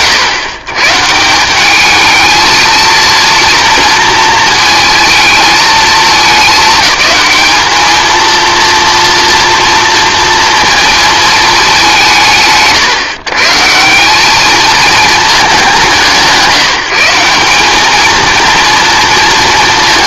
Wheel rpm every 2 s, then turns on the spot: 110, 230, 220, 200, 230, 230, 110, 220, 160, 230.
none